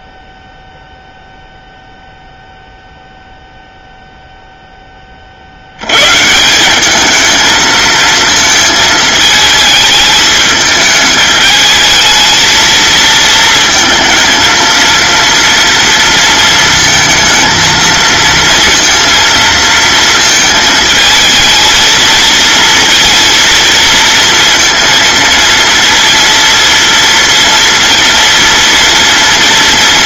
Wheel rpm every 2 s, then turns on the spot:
0, 0, 20, 200, 220, 220, 230, 230, 230, 230, 220, 230, 230, 230, 230.
none